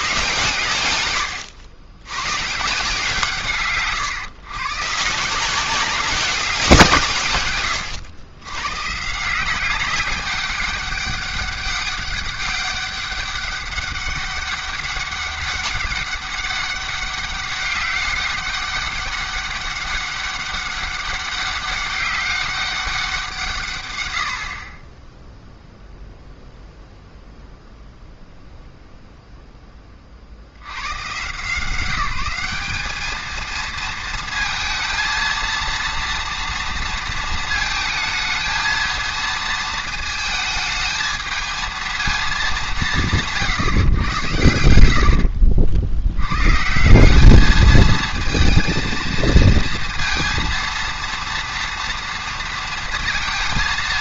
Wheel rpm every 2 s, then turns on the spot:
130, 140, 140, 190, 120, 200, 200, 200, 200, 200, 200, 200, 50, 0, 0, 80, 200, 220, 230, 220, 220, 210, 90, 140, 230, 230, 230.
44-46